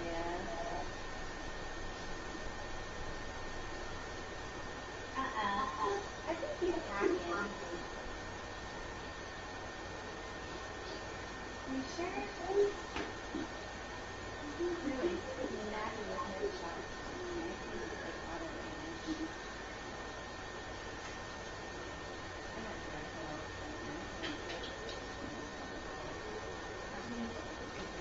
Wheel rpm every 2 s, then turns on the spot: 0, 0, 0, 0, 0, 0, 0, 0, 0, 0, 0, 0, 0, 0.
none